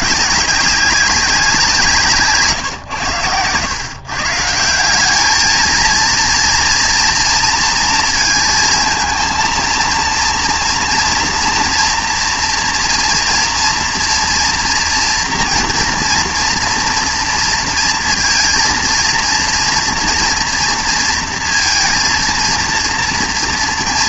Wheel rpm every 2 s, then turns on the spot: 190, 110, 190, 230, 230, 230, 240, 240, 230, 230, 230, 230.
none